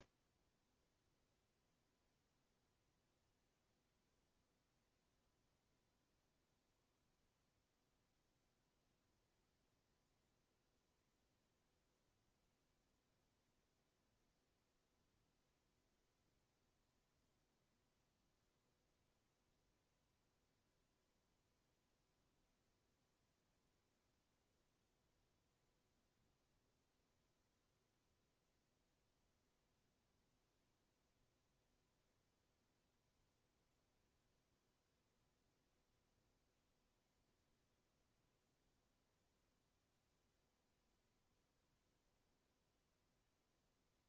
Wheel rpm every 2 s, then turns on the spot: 0, 0, 0, 0, 0, 0, 0, 0, 0, 0, 0, 0, 0, 0, 0, 0, 0, 0, 0, 0, 0, 0.
none